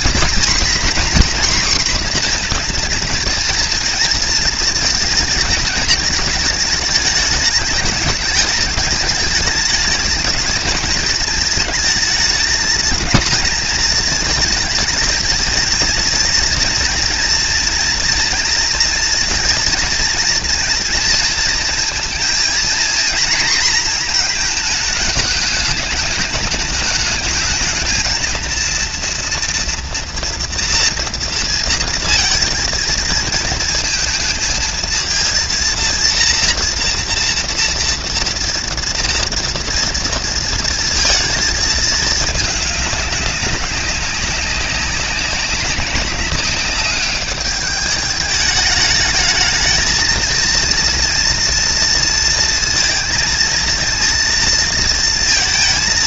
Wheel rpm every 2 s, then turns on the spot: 250, 240, 230, 220, 210, 220, 230, 220, 230, 230, 230, 230, 220, 220, 230, 240, 230, 220, 230, 230, 230, 210, 190, 200, 210, 230, 230, 230.
none